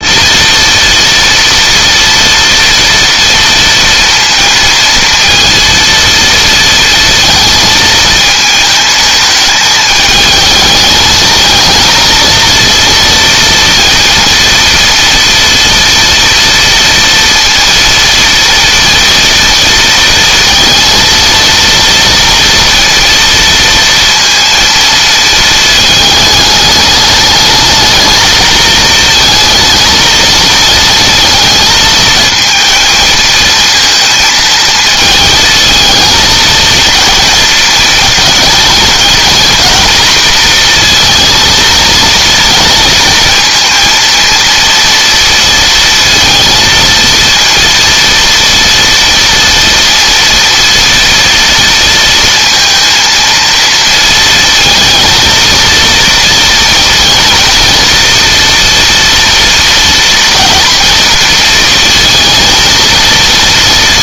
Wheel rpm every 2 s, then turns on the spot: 230, 230, 230, 230, 220, 220, 230, 230, 230, 230, 230, 230, 230, 210, 220, 220, 230, 220, 230, 220, 230, 230, 230, 230, 230, 230, 230, 230, 230, 230, 230, 230.
none